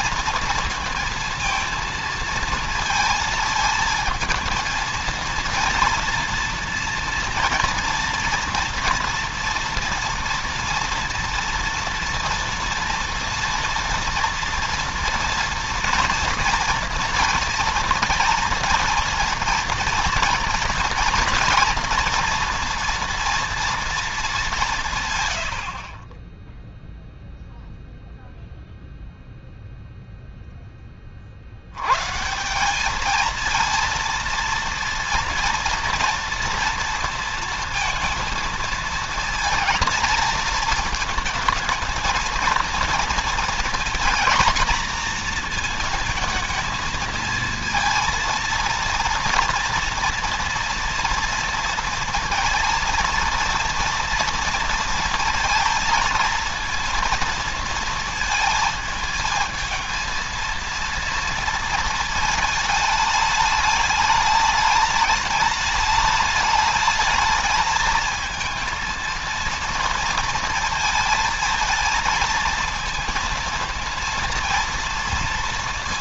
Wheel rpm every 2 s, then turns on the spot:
230, 220, 230, 240, 230, 230, 230, 230, 230, 230, 230, 230, 170, 0, 0, 20, 200, 230, 230, 230, 220, 230, 240, 220, 230, 240, 230, 230, 230, 220, 230, 220, 210, 210, 230, 230, 230, 230.
none